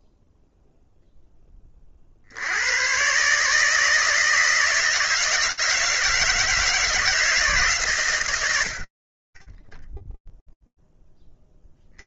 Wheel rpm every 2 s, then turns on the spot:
0, 50, 160, 160, 130, 0.
none